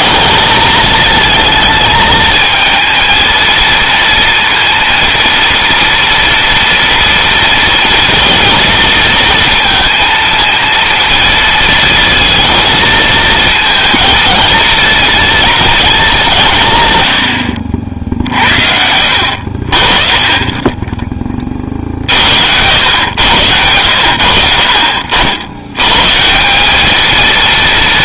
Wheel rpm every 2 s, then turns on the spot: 220, 230, 230, 230, 230, 230, 230, 230, 130, 60, 10, 100, 60, 200.
none